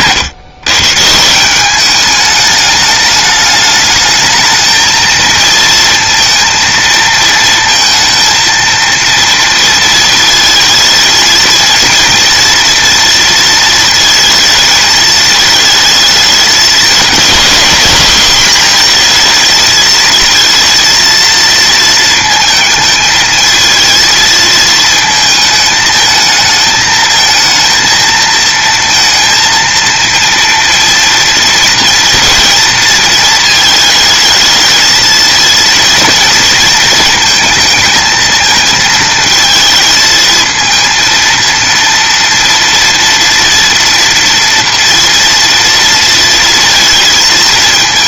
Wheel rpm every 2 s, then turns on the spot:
140, 210, 230, 230, 230, 220, 230, 220, 220, 230, 230, 220, 220, 220, 230, 230, 230, 220, 220, 220, 230, 230, 230, 230.
none